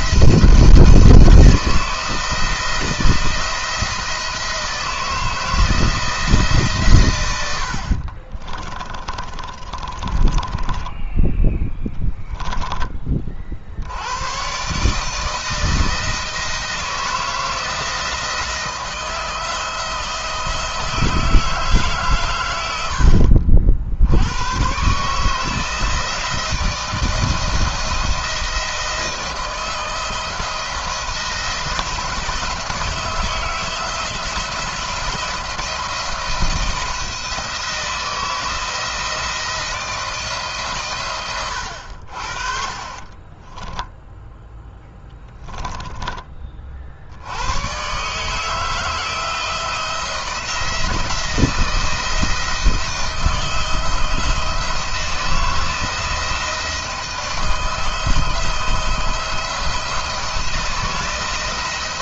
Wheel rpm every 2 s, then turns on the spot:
170, 160, 160, 130, 30, 20, 20, 140, 160, 170, 160, 100, 130, 160, 160, 160, 160, 170, 160, 160, 130, 30, 10, 50, 160, 170, 160, 170, 160, 160, 170.
8-12 42-46